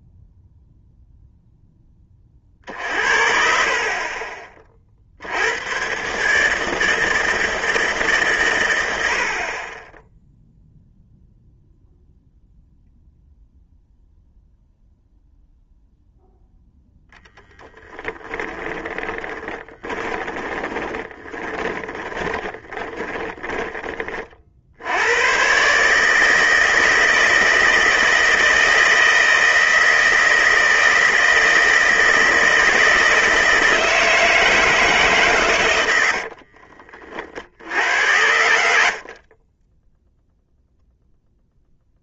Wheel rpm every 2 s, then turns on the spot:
0, 40, 30, 150, 110, 0, 0, 0, 0, 20, 30, 20, 60, 160, 160, 160, 160, 160, 50, 70, 0.
18-24 36-40